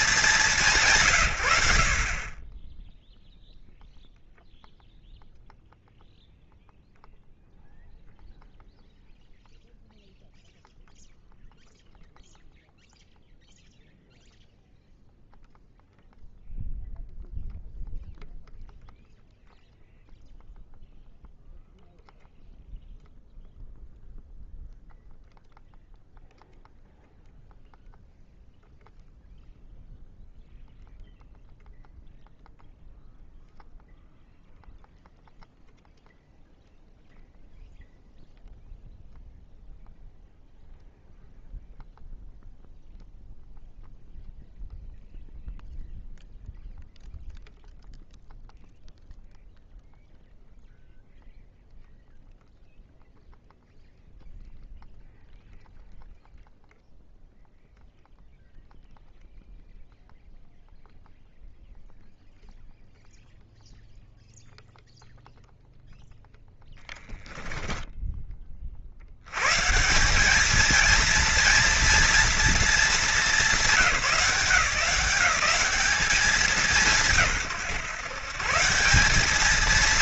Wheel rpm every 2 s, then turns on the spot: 100, 0, 0, 0, 0, 0, 0, 0, 0, 0, 0, 0, 0, 0, 0, 0, 0, 0, 0, 0, 0, 0, 0, 0, 0, 0, 0, 0, 0, 0, 0, 0, 0, 10, 60, 220, 230, 180, 180, 140.
66-68